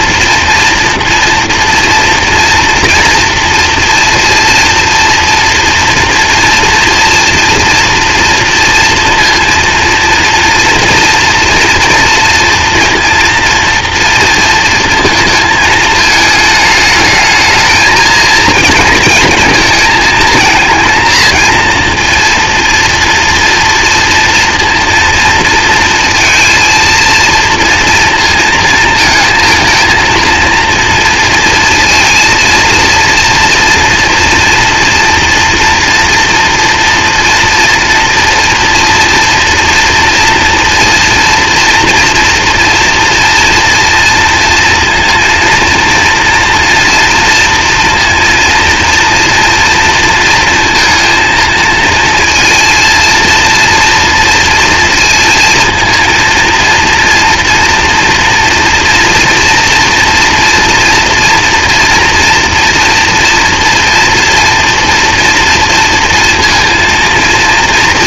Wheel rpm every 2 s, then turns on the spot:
230, 230, 230, 230, 230, 240, 230, 230, 220, 230, 230, 230, 240, 230, 230, 230, 230, 230, 240, 240, 230, 230, 230, 230, 230, 230, 230, 230, 230, 240, 230, 230, 230, 230.
none